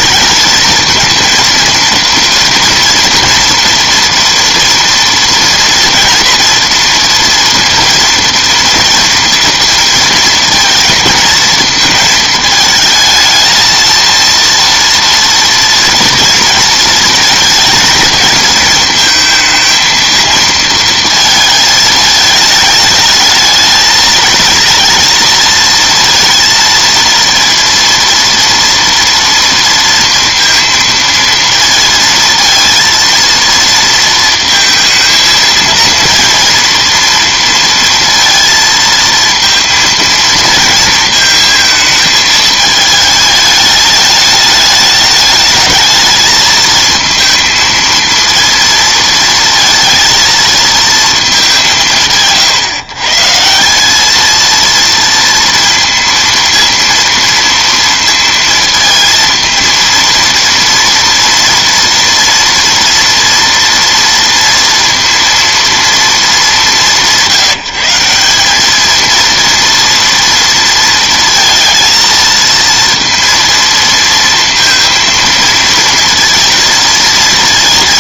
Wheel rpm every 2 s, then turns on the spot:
220, 230, 230, 230, 230, 230, 220, 230, 230, 220, 230, 220, 230, 230, 230, 230, 230, 230, 230, 230, 230, 220, 210, 220, 230, 230, 140, 230, 230, 230, 230, 230, 230, 170, 200, 230, 230, 230, 230.
none